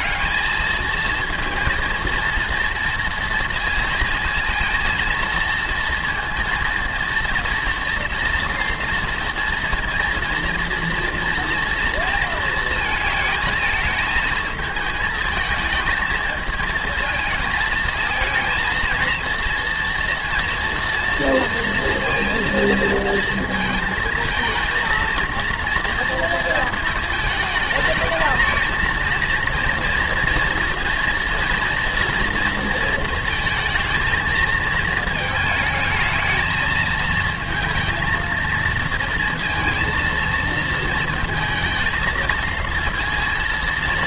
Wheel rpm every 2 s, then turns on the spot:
220, 230, 230, 230, 240, 230, 220, 220, 220, 230, 230, 230, 230, 230, 220, 230, 230, 220, 220, 230, 230, 230.
none